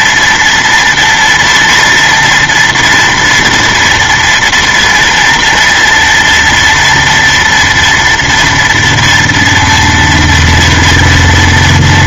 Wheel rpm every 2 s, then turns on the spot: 230, 230, 240, 230, 240, 230.
none